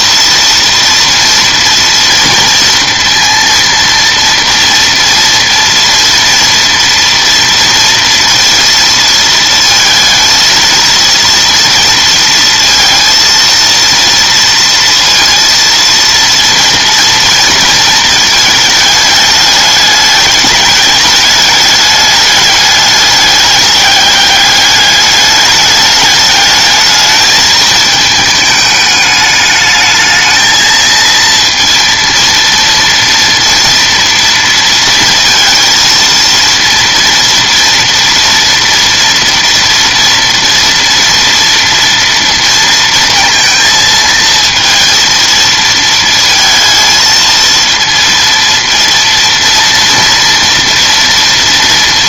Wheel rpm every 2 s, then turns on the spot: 230, 230, 230, 230, 230, 230, 230, 230, 230, 220, 210, 210, 210, 210, 210, 220, 230, 230, 230, 230, 230, 230, 230, 230, 230, 230.
none